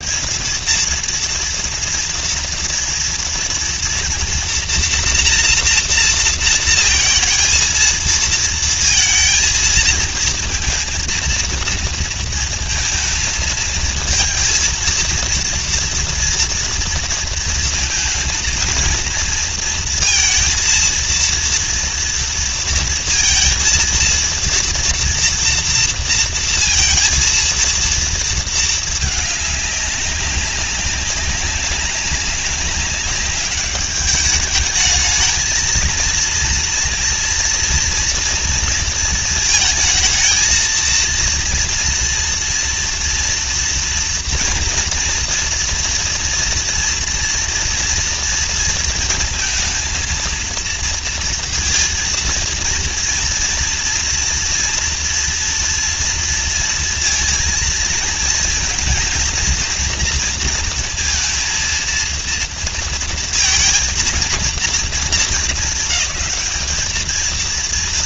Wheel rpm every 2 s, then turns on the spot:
230, 230, 230, 230, 230, 230, 220, 230, 230, 230, 230, 230, 230, 230, 220, 200, 200, 210, 230, 230, 230, 230, 230, 230, 230, 230, 230, 230, 230, 230, 230, 230, 220, 220.
none